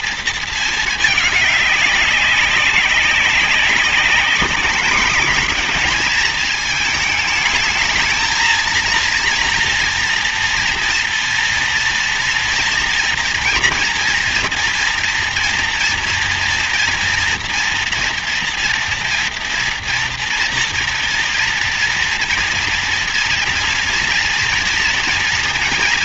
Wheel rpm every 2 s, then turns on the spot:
230, 190, 210, 220, 230, 230, 230, 230, 230, 240, 230, 230, 230.
none